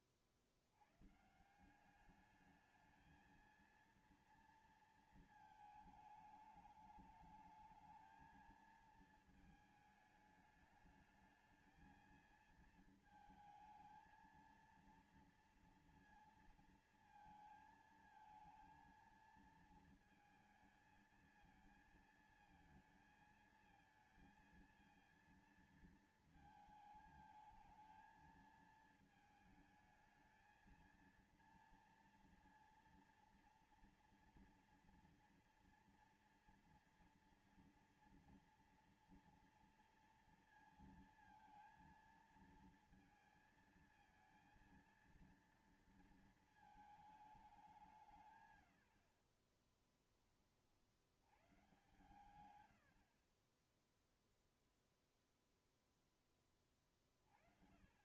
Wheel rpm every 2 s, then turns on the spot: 50, 210, 230, 210, 220, 210, 220, 230, 230, 220, 220, 220, 230, 220, 220, 220, 230, 230, 240, 230, 230, 230, 230, 220, 130, 40, 100, 0, 20.
none